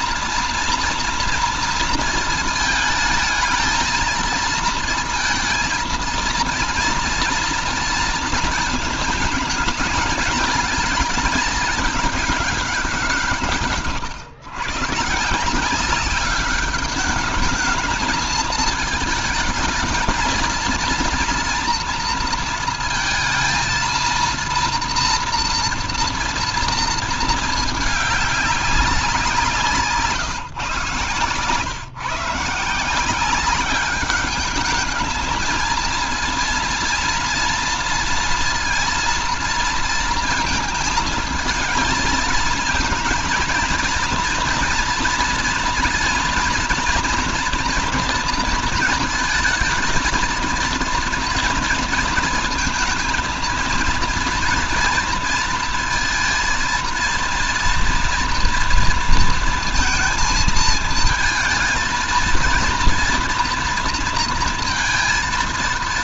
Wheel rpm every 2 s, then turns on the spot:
240, 220, 230, 230, 220, 210, 200, 140, 200, 220, 230, 230, 230, 230, 200, 140, 160, 210, 230, 230, 230, 220, 230, 230, 230, 230, 230, 230, 220, 230, 220, 230, 230.
none